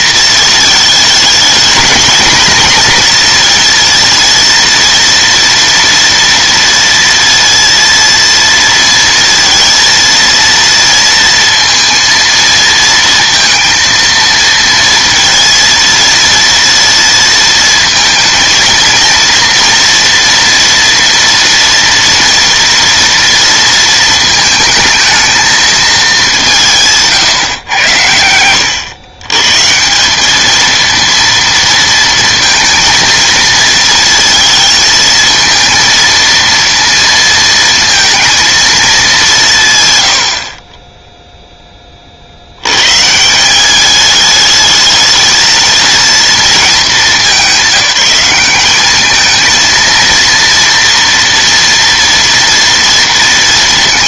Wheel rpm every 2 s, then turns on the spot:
220, 240, 230, 230, 230, 230, 230, 230, 230, 230, 240, 230, 220, 160, 100, 220, 220, 220, 230, 220, 20, 120, 220, 220, 200, 230, 230.
none